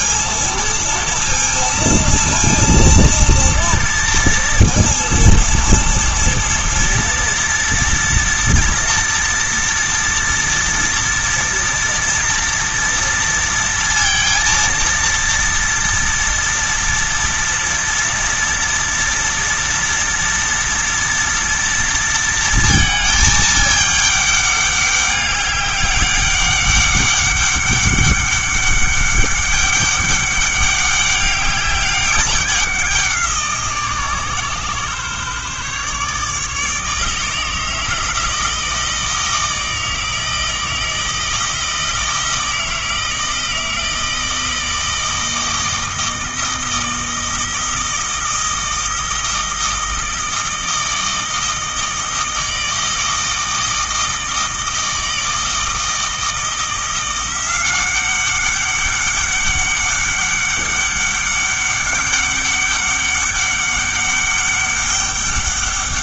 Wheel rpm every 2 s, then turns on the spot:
230, 230, 230, 230, 230, 230, 230, 230, 230, 230, 230, 220, 200, 200, 200, 200, 190, 140, 150, 160, 160, 160, 160, 160, 160, 160, 160, 160, 170, 200, 200, 200, 200.
none